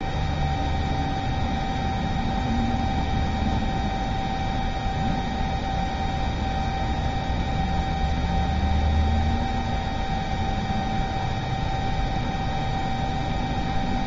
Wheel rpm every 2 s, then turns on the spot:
0, 0, 0, 0, 0, 0, 0.
none